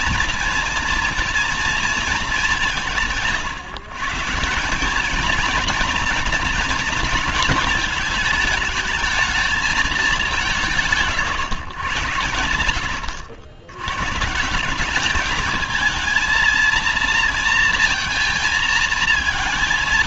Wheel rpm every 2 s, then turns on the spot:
230, 210, 160, 230, 220, 170, 90, 160, 230, 220.
none